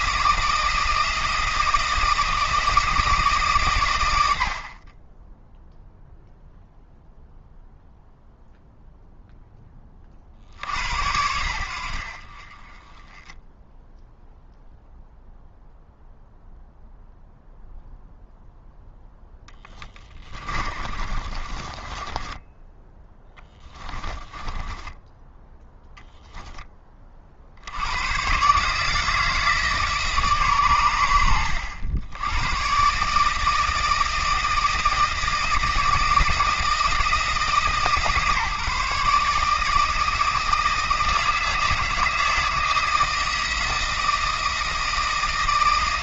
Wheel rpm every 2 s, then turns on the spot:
160, 160, 30, 0, 0, 80, 20, 0, 0, 0, 30, 20, 10, 20, 150, 110, 140, 160, 160, 150, 160, 160, 160.
20-26